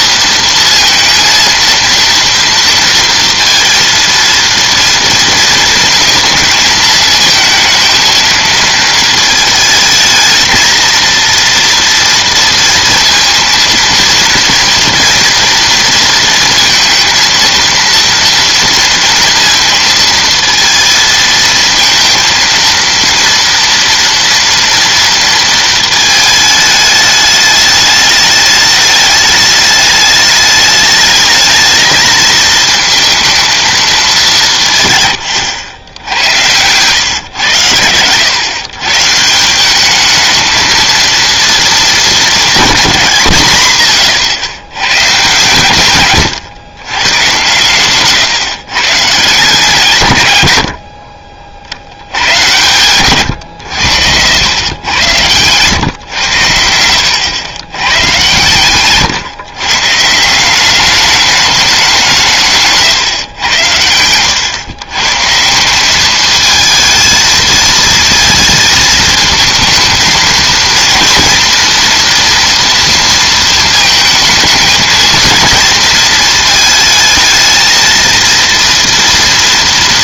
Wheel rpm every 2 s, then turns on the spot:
230, 230, 230, 220, 220, 220, 230, 230, 230, 230, 230, 230, 230, 210, 210, 210, 220, 150, 110, 130, 220, 210, 130, 130, 130, 70, 120, 90, 90, 130, 190, 150, 120, 220, 220, 230, 230, 220, 220, 230.
62-64